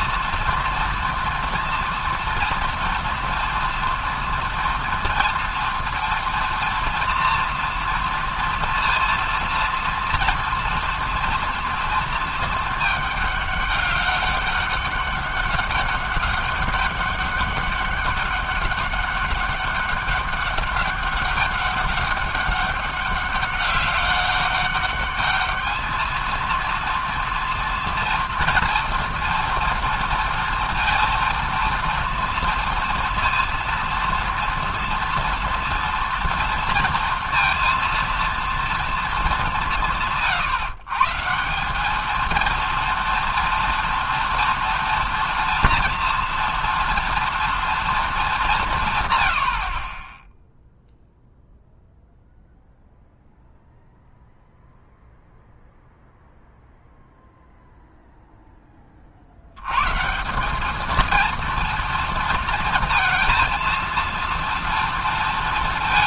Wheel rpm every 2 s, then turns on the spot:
240, 240, 230, 230, 230, 230, 220, 200, 200, 200, 200, 200, 200, 230, 230, 230, 230, 230, 230, 230, 130, 230, 230, 230, 200, 0, 0, 0, 0, 10, 200, 230, 230.
none